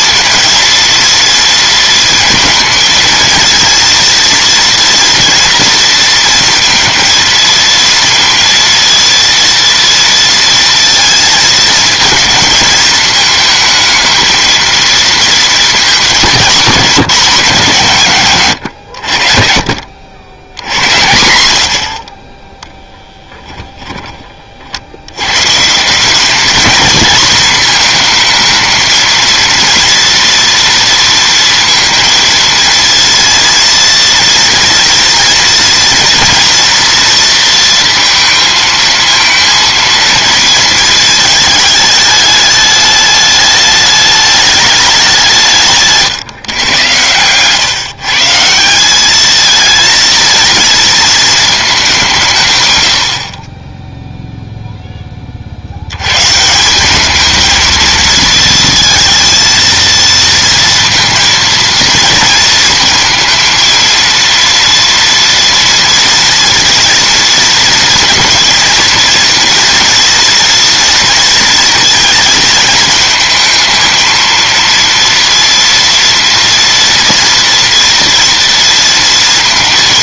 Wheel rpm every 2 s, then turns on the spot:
230, 220, 230, 230, 230, 230, 220, 220, 200, 110, 80, 10, 60, 220, 230, 230, 230, 230, 230, 220, 220, 210, 200, 110, 190, 220, 100, 10, 190, 230, 230, 230, 230, 230, 230, 230, 220, 230, 230, 230.
none